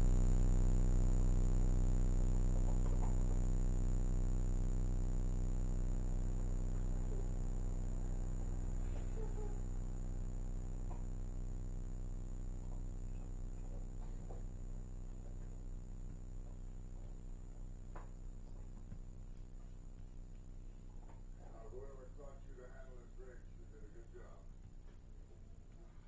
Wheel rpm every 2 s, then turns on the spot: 0, 0, 0, 0, 0, 0, 0, 0, 0, 0, 0, 0, 0.
none